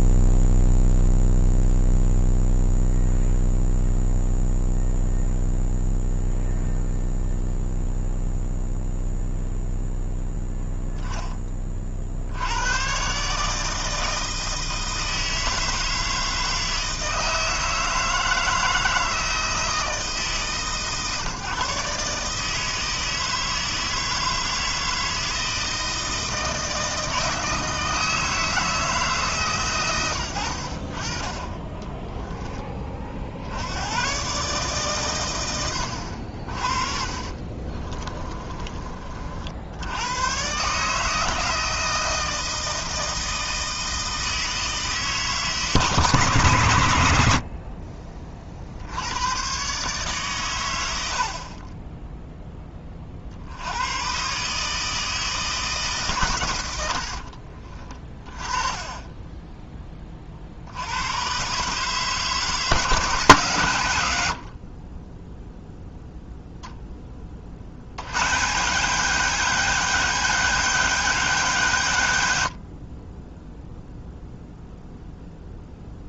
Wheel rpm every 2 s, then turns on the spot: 0, 0, 0, 0, 0, 0, 100, 160, 160, 160, 140, 160, 160, 160, 160, 60, 20, 140, 50, 30, 140, 160, 160, 120, 60, 100, 10, 150, 110, 20, 70, 160, 40, 0, 140, 180, 60, 0.
36-38 58-60